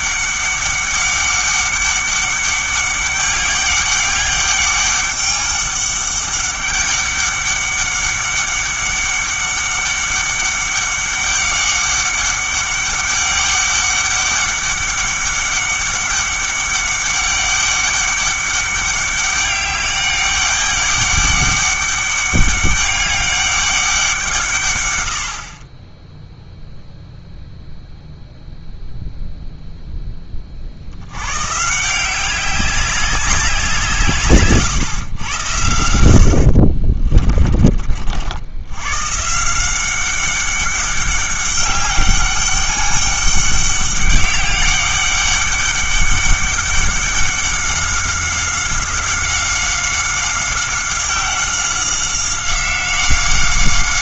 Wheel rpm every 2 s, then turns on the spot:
200, 200, 200, 200, 200, 200, 200, 200, 200, 200, 200, 200, 140, 0, 0, 50, 190, 130, 40, 90, 200, 200, 200, 200, 190, 190, 190.
36-38